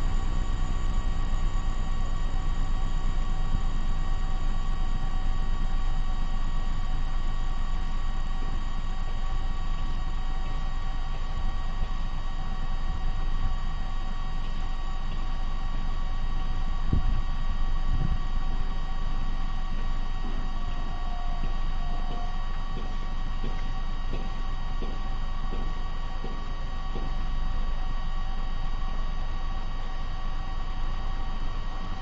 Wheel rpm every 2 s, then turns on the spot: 0, 0, 0, 0, 0, 0, 0, 0, 0, 0, 0, 0, 0, 0, 0, 0.
none